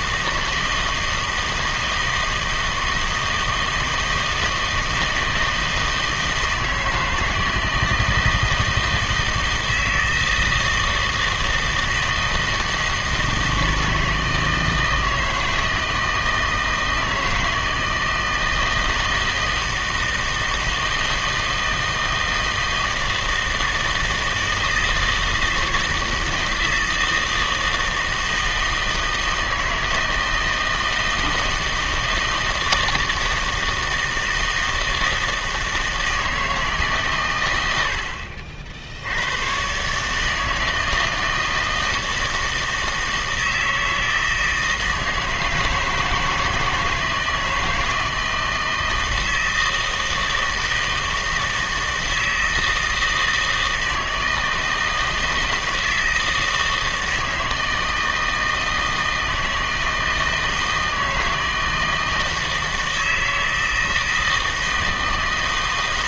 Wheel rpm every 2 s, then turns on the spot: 160, 160, 160, 160, 160, 160, 160, 160, 160, 160, 160, 160, 160, 160, 160, 160, 160, 160, 160, 60, 160, 160, 160, 160, 160, 160, 160, 160, 160, 160, 160, 160, 160.
none